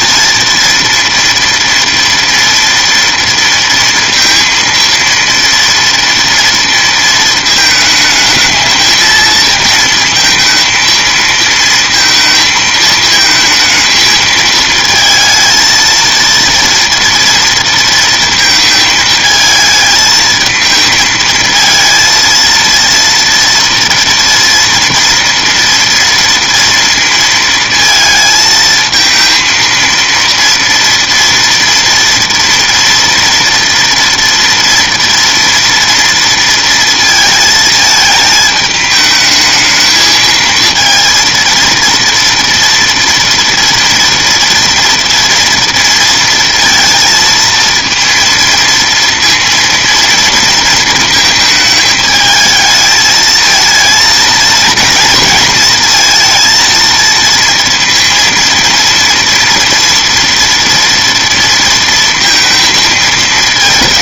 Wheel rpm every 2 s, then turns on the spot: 230, 230, 230, 230, 220, 230, 220, 220, 230, 220, 220, 230, 230, 230, 220, 230, 230, 230, 230, 220, 230, 230, 230, 230, 230, 230, 220, 230, 230, 230, 230, 230.
none